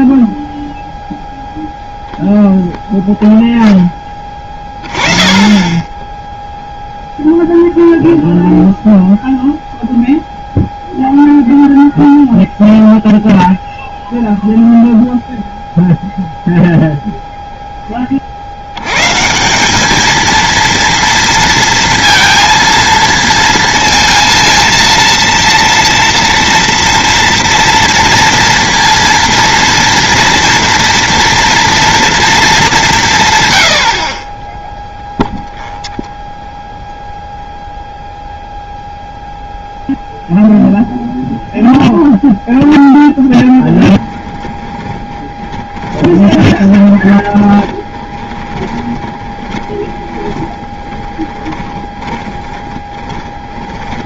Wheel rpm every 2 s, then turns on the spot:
0, 0, 20, 0, 0, 0, 0, 0, 0, 70, 230, 230, 230, 230, 230, 230, 220, 10, 0, 0, 0, 0, 20, 20, 20, 20, 20.
44-54